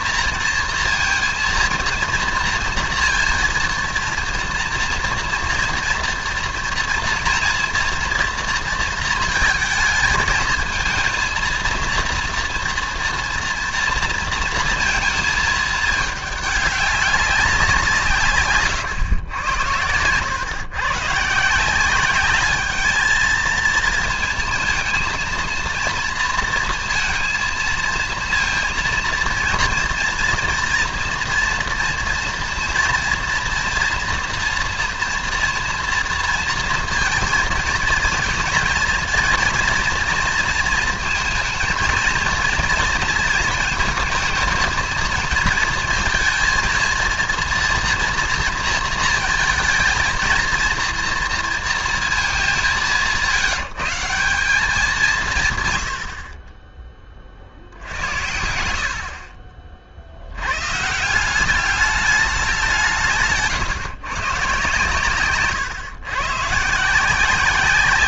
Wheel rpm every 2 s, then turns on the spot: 230, 230, 240, 230, 230, 220, 230, 230, 200, 120, 130, 220, 220, 230, 230, 230, 230, 230, 230, 230, 230, 230, 230, 230, 230, 230, 180, 180, 20, 70, 130, 180, 130, 160.
none